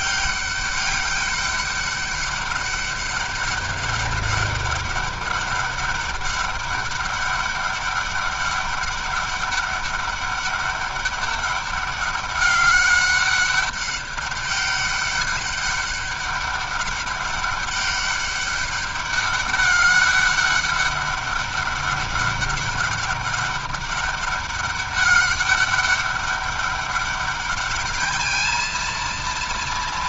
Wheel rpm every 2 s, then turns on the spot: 200, 200, 200, 200, 200, 200, 200, 200, 200, 200, 200, 200, 200, 200, 220.
none